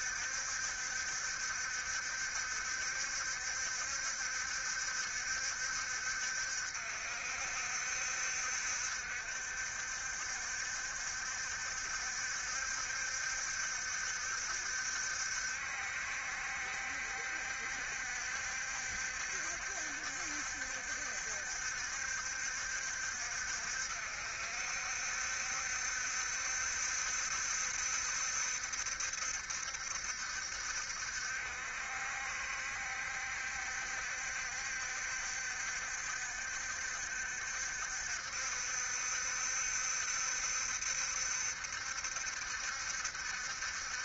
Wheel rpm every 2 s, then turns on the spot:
70, 70, 70, 60, 70, 70, 70, 70, 70, 70, 70, 60, 70, 70, 70, 60, 70, 60, 70, 70, 70, 70.
none